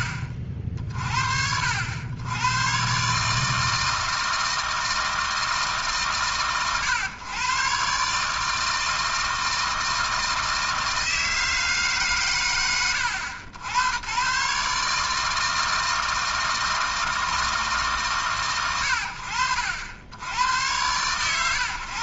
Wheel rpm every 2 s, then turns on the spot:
50, 140, 160, 120, 160, 160, 70, 150, 160, 60, 110.
none